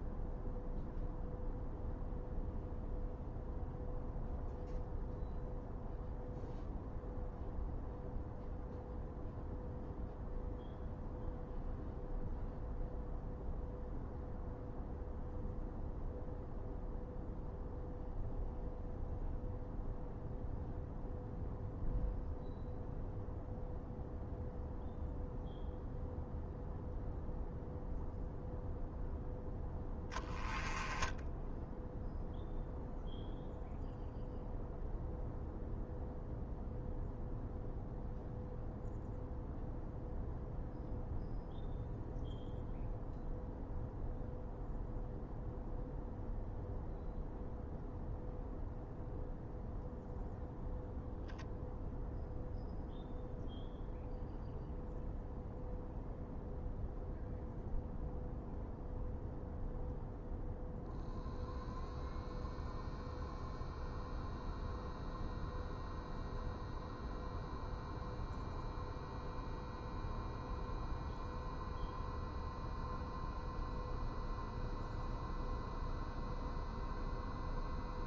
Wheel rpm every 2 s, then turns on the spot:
0, 0, 0, 0, 0, 0, 0, 0, 0, 0, 0, 0, 0, 0, 0, 10, 0, 0, 0, 0, 0, 0, 0, 0, 0, 0, 0, 0, 0, 0, 0, 0, 0, 0, 0, 0, 0, 0, 0.
none